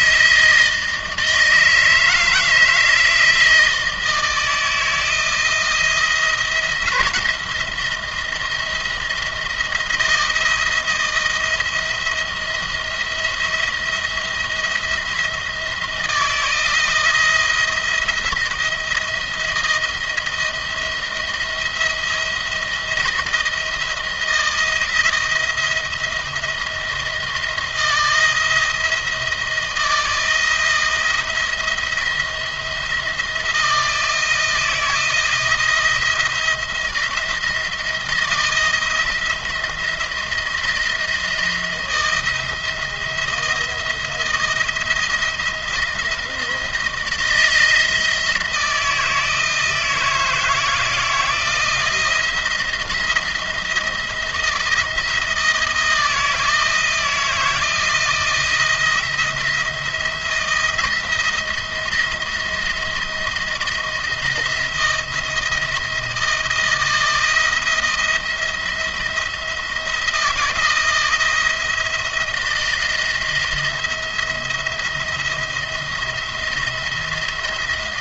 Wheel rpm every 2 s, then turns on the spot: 160, 160, 160, 170, 170, 170, 170, 170, 160, 170, 160, 170, 160, 170, 170, 170, 170, 160, 170, 170, 170, 170, 160, 170, 160, 170, 170, 160, 170, 170, 170, 170, 160, 160, 160, 160, 160, 170, 170.
none